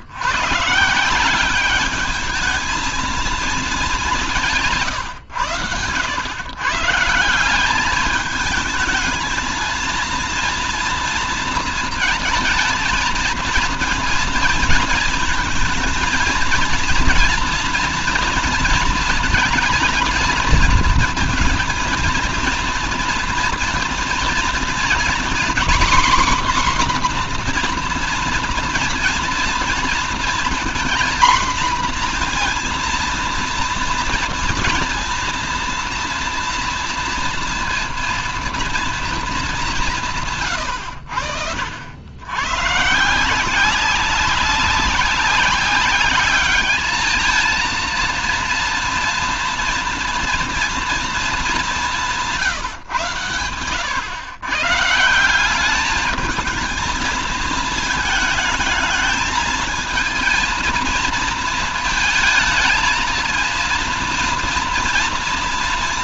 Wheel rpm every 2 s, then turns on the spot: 150, 220, 160, 130, 220, 230, 220, 230, 230, 230, 230, 230, 230, 260, 240, 240, 230, 230, 230, 230, 100, 130, 190, 210, 230, 230, 160, 140, 220, 220, 230, 220, 230.
none